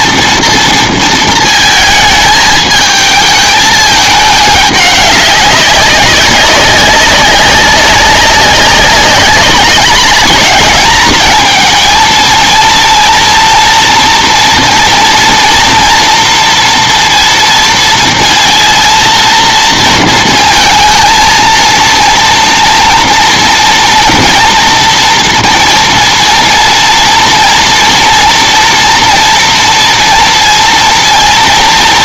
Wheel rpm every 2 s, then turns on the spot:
230, 220, 200, 200, 200, 210, 230, 230, 230, 230, 230, 230, 230, 230, 230, 230.
none